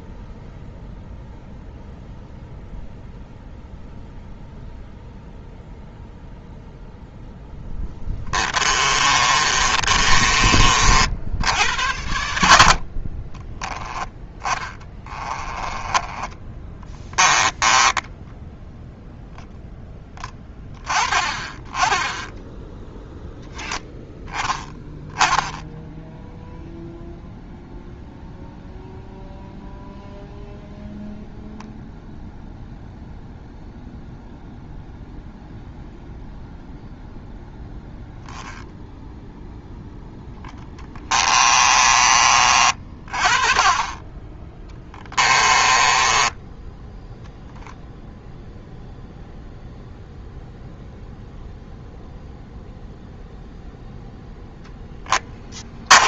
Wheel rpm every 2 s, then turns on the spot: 0, 0, 0, 0, 20, 50, 40, 20, 20, 0, 20, 0, 10, 0, 0, 0, 0, 0, 0, 0, 10, 40, 20, 0, 0, 0, 0, 10.
8-10 14-18 40-42 44-46 54-56